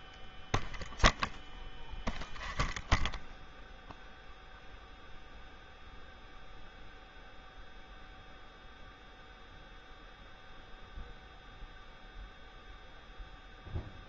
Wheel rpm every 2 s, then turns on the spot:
0, 0, 0, 0, 0, 0, 0.
none